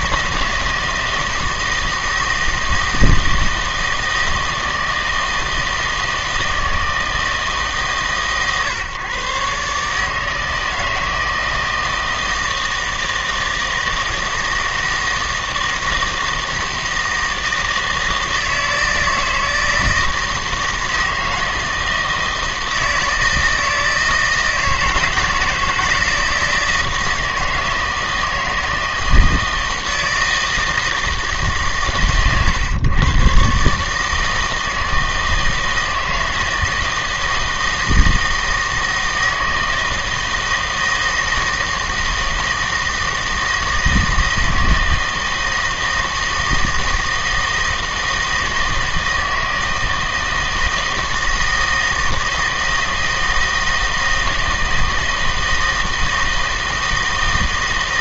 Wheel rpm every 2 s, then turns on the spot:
160, 160, 160, 160, 130, 160, 160, 160, 160, 160, 160, 160, 160, 160, 160, 160, 120, 160, 160, 160, 160, 160, 160, 160, 160, 160, 160, 160, 160.
none